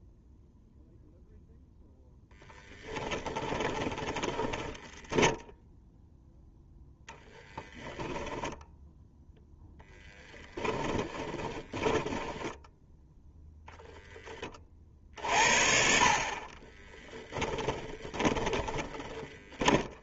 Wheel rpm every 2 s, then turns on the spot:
0, 10, 20, 0, 0, 10, 10, 30, 30, 20.
2-6 10-14 16-20